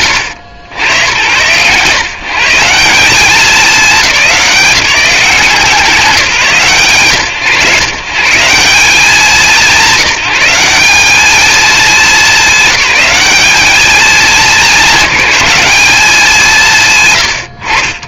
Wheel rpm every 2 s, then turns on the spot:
90, 170, 180, 120, 180, 190, 200, 210, 180.
none